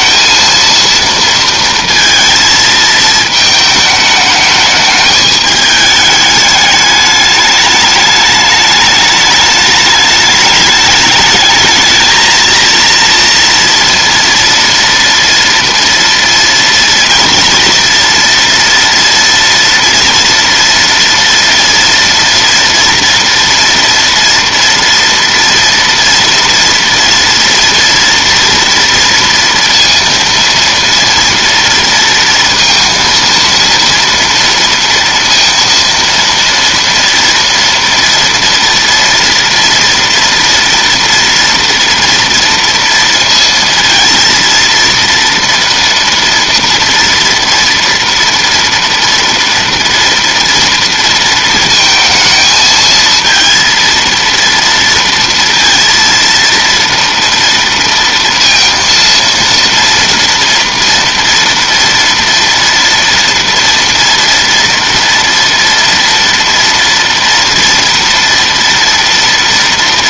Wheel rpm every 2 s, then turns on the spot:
230, 220, 210, 210, 210, 210, 230, 230, 230, 230, 230, 230, 230, 230, 230, 230, 230, 230, 230, 240, 240, 230, 230, 230, 230, 230, 220, 230, 230, 230, 230, 230, 230, 230, 230.
none